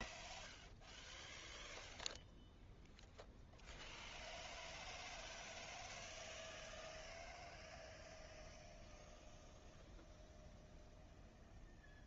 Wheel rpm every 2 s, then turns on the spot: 0, 0, 0, 0, 0, 0.
none